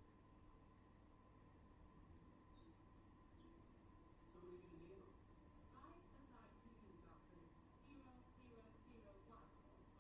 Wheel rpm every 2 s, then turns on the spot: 0, 0, 0, 0, 0.
none